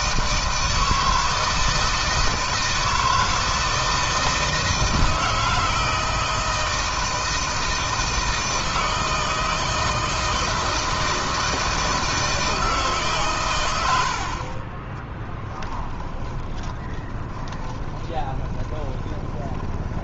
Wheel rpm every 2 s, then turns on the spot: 160, 160, 160, 160, 160, 160, 150, 30, 20, 20.
16-20